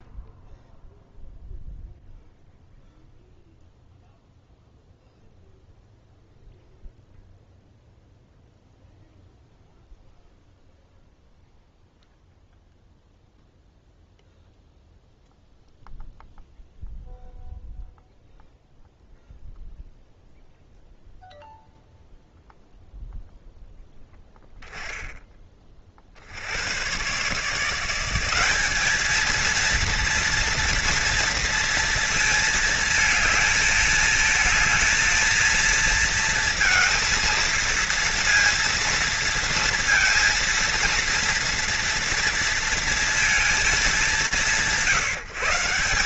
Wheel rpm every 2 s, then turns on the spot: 0, 0, 0, 0, 0, 0, 0, 0, 0, 0, 0, 0, 10, 80, 190, 240, 220, 220, 230, 240, 230, 230, 160.
none